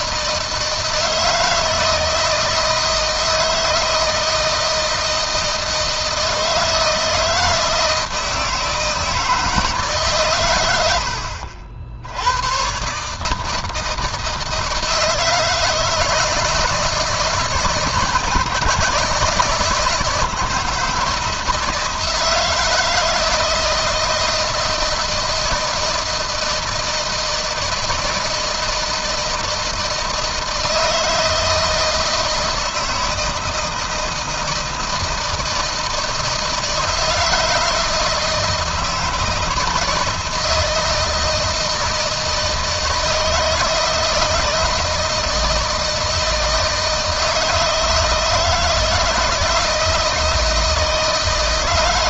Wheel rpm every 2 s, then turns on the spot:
160, 160, 160, 160, 160, 90, 130, 160, 160, 150, 160, 160, 160, 160, 160, 160, 160, 160, 170, 160, 160, 160, 160, 160, 160, 160.
none